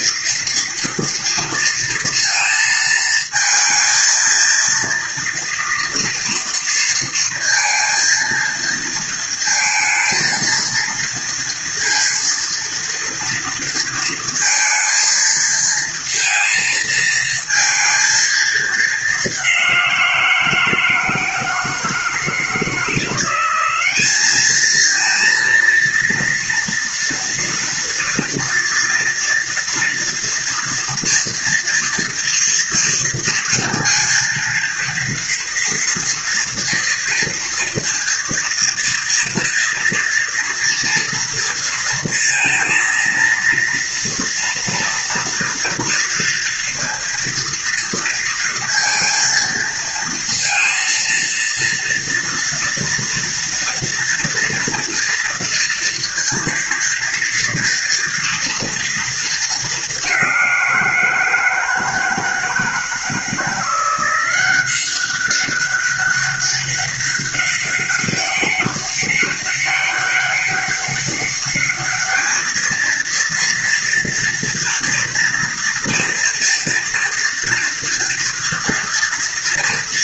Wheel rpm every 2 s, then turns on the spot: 230, 230, 230, 230, 230, 230, 230, 230, 230, 210, 160, 170, 220, 240, 230, 240, 230, 230, 230, 230, 230, 230, 230, 230, 230, 230, 230, 240, 230, 230, 170, 160, 190, 200, 200, 200, 230, 230, 230, 230.
none